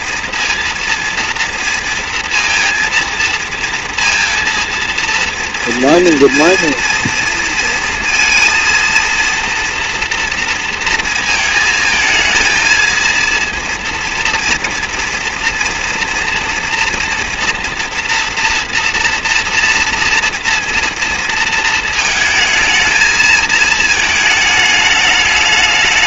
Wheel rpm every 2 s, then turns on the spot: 230, 230, 230, 230, 230, 230, 220, 230, 230, 240, 230, 220, 220.
none